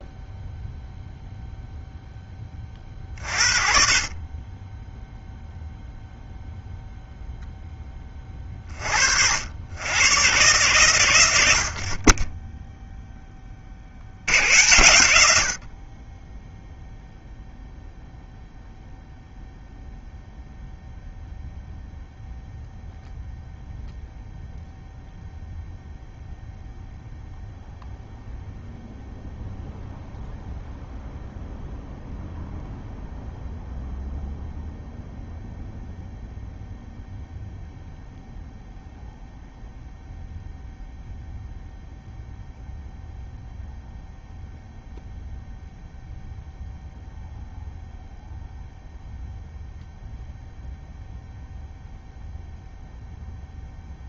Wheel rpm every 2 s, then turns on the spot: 0, 30, 10, 0, 40, 120, 0, 100, 0, 0, 0, 0, 0, 0, 0, 0, 0, 0, 0, 0, 0, 0, 0, 0, 0, 0, 0.
none